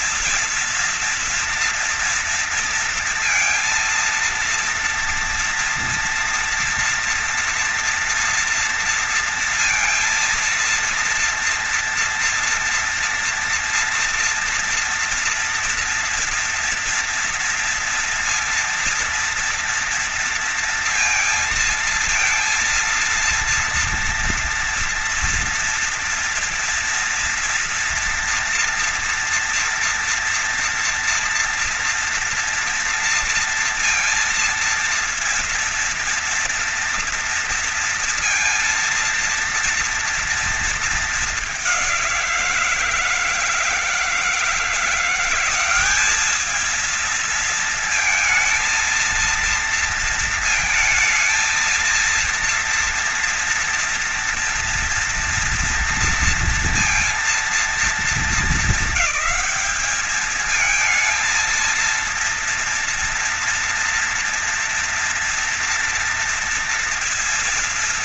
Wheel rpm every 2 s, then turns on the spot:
230, 230, 230, 240, 230, 230, 230, 230, 230, 240, 230, 230, 230, 230, 240, 230, 230, 230, 230, 230, 220, 160, 170, 220, 230, 230, 230, 240, 230, 220, 220, 230, 230, 230.
none